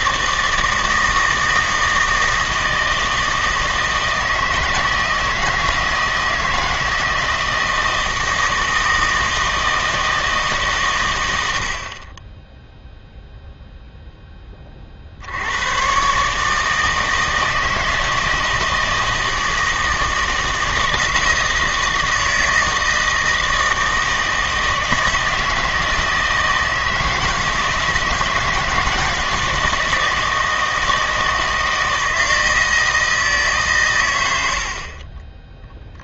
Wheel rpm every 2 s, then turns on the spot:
160, 160, 160, 160, 160, 140, 0, 30, 150, 160, 160, 160, 160, 160, 160, 160, 160, 60.
34-36